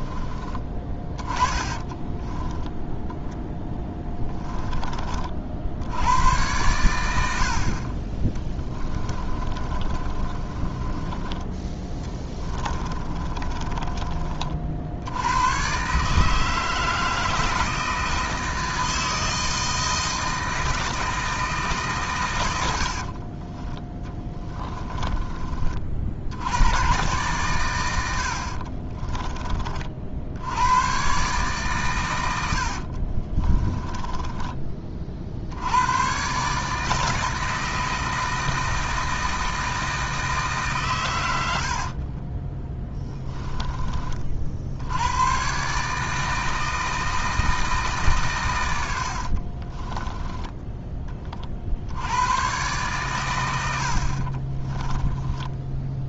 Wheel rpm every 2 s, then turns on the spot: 20, 0, 20, 90, 30, 20, 20, 60, 160, 160, 160, 70, 20, 110, 40, 110, 40, 30, 150, 160, 130, 10, 90, 160, 80, 20, 120, 10.
8-14 24-26 28-30 32-34 42-44 54-56